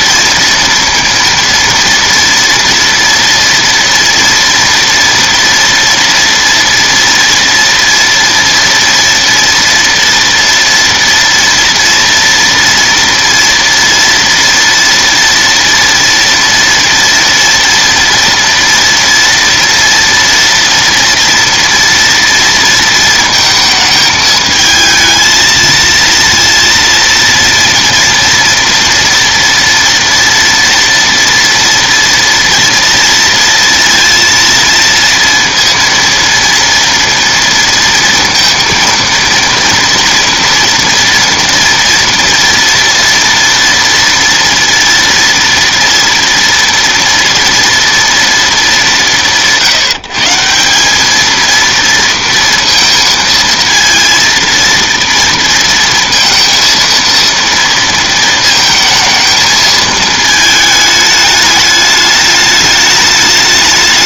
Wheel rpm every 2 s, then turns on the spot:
230, 230, 230, 240, 230, 230, 230, 240, 230, 230, 230, 230, 220, 230, 230, 230, 230, 230, 230, 230, 230, 230, 230, 230, 230, 170, 230, 230, 230, 220, 220, 210.
none